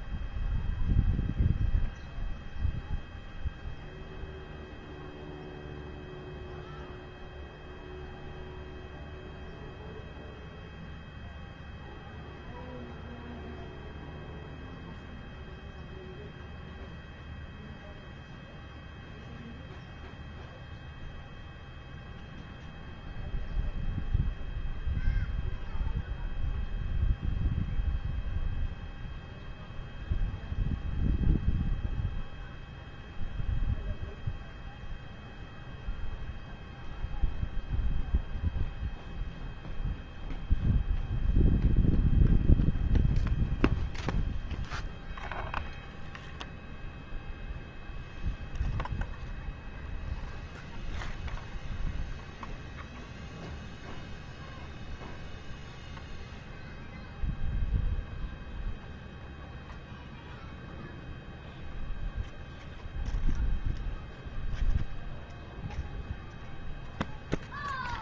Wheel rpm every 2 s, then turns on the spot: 0, 0, 0, 0, 0, 0, 0, 0, 0, 0, 0, 0, 0, 0, 0, 0, 0, 0, 0, 0, 0, 0, 0, 0, 0, 0, 0, 0, 0, 0, 0, 0, 0, 0.
none